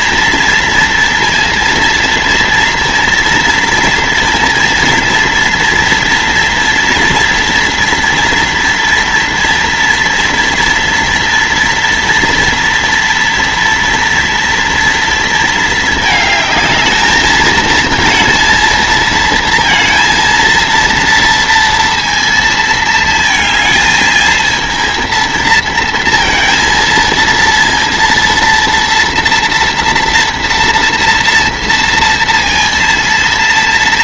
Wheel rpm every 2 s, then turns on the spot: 230, 230, 230, 230, 230, 230, 230, 230, 220, 230, 230, 220, 230, 230, 230, 230, 230.
none